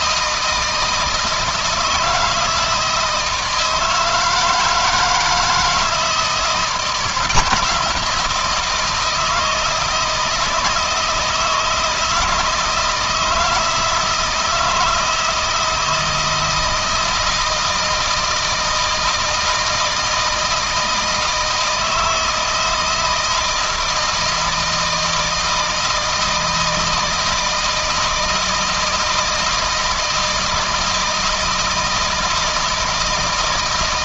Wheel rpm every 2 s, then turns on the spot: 160, 160, 160, 170, 160, 160, 160, 160, 160, 160, 160, 160, 160, 160, 160, 160, 160.
none